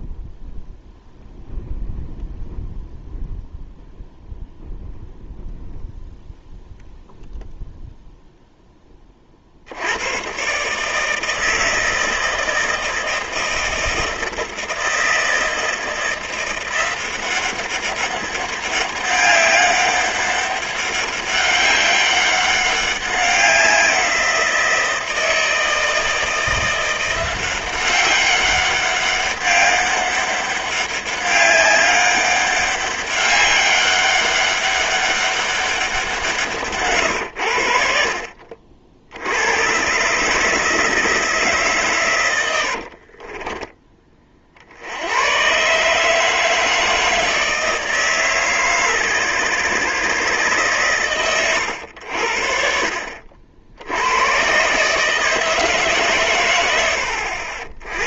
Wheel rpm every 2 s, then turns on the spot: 0, 0, 0, 0, 20, 150, 160, 160, 180, 200, 200, 190, 170, 170, 200, 200, 200, 200, 130, 60, 160, 60, 70, 160, 140, 120, 50, 130, 90.
42-44